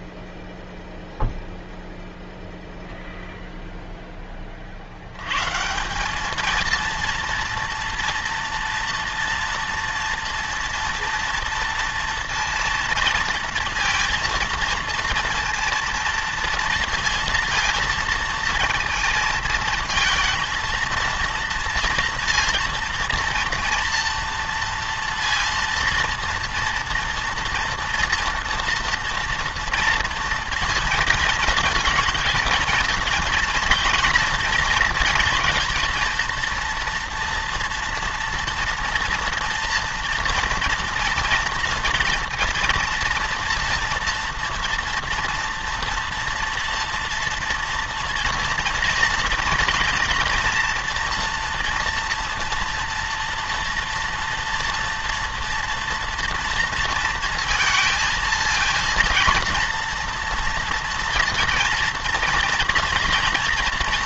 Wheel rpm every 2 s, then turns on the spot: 0, 0, 40, 220, 230, 230, 230, 230, 230, 230, 220, 230, 230, 230, 230, 230, 220, 230, 230, 230, 230, 230, 230, 240, 230, 230, 230, 230, 230, 220, 230, 230.
none